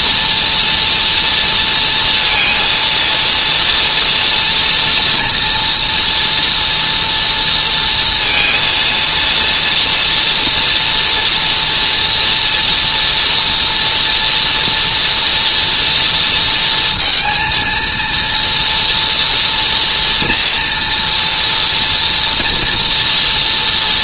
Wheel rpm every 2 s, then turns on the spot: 230, 230, 230, 230, 230, 230, 230, 240, 230, 240, 230, 230.
none